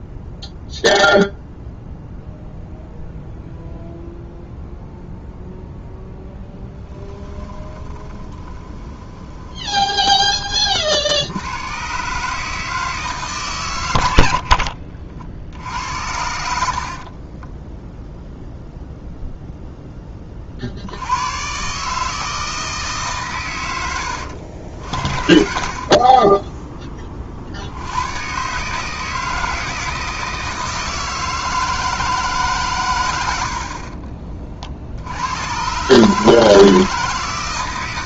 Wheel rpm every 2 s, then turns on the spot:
0, 0, 0, 10, 20, 40, 160, 80, 60, 0, 40, 150, 60, 20, 140, 160, 140, 50, 160.
6-10 14-16